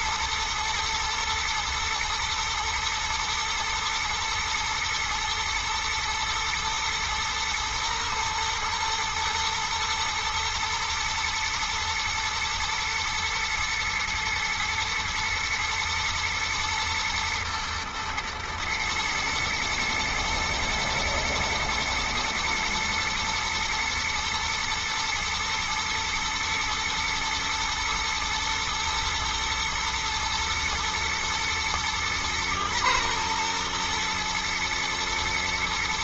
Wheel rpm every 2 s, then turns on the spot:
110, 110, 110, 120, 110, 110, 110, 120, 120, 120, 120, 120, 110, 110, 110, 120, 120, 120.
none